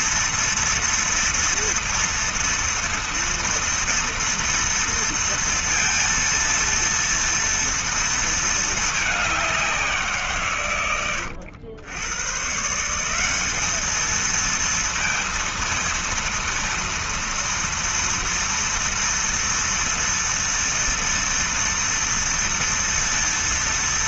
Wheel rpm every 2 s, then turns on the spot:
230, 230, 230, 230, 220, 120, 150, 230, 230, 230, 230, 230.
none